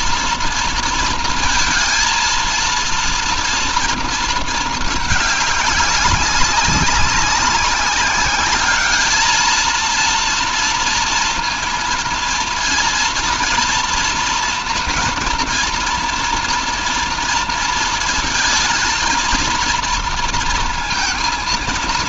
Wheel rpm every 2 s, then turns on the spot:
230, 230, 220, 200, 210, 230, 230, 230, 240, 230, 230.
none